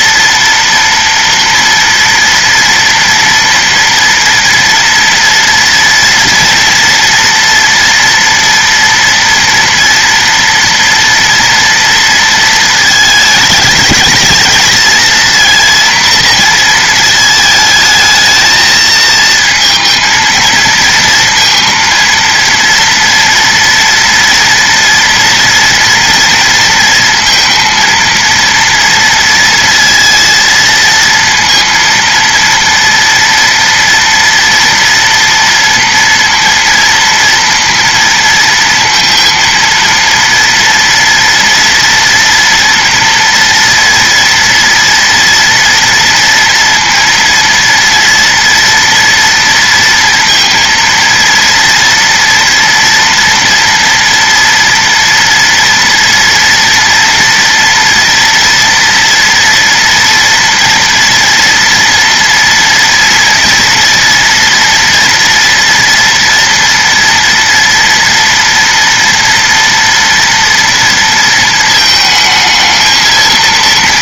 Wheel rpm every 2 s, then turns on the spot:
240, 240, 230, 230, 230, 230, 220, 220, 230, 220, 230, 230, 230, 230, 230, 230, 230, 230, 230, 230, 230, 240, 230, 230, 230, 230, 230, 230, 230, 230, 230, 230, 230, 230, 230, 240, 220.
none